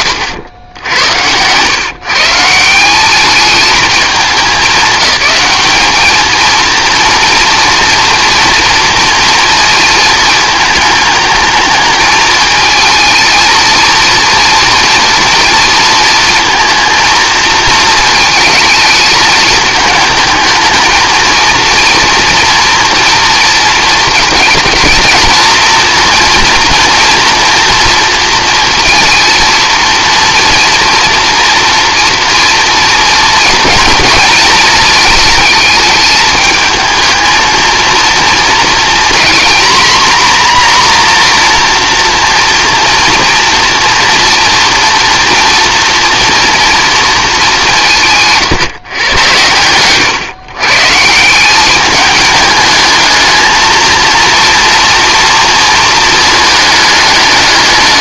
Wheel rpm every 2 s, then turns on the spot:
70, 180, 210, 230, 230, 220, 220, 230, 230, 220, 220, 230, 220, 230, 230, 230, 230, 220, 220, 230, 250, 230, 230, 240, 140, 140, 210, 230, 220.
none